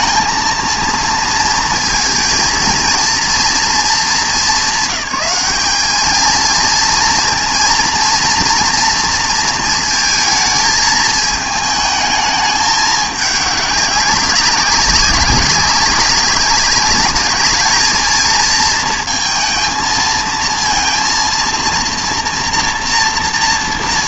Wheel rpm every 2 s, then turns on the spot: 230, 230, 190, 230, 230, 220, 210, 190, 200, 220, 230, 230.
none